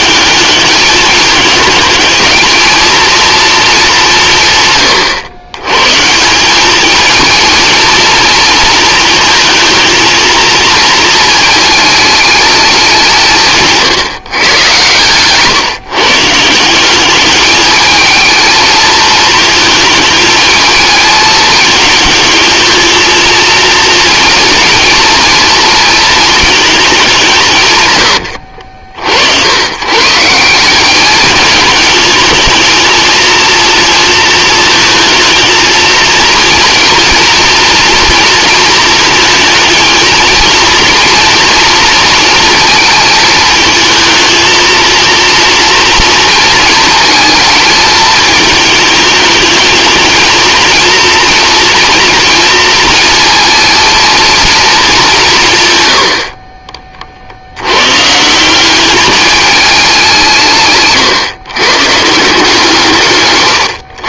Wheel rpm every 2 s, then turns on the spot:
210, 230, 140, 220, 230, 220, 190, 130, 190, 220, 210, 220, 230, 210, 70, 190, 220, 220, 240, 220, 230, 220, 230, 230, 210, 230, 230, 200, 40, 200, 140, 170.
14-16